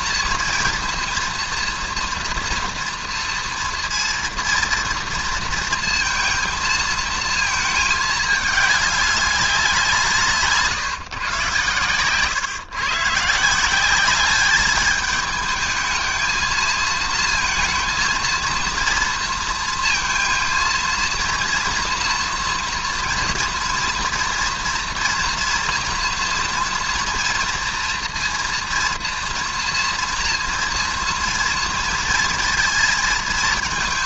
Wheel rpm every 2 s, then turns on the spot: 230, 230, 230, 230, 210, 150, 140, 200, 220, 230, 230, 230, 230, 230, 230, 240, 230.
none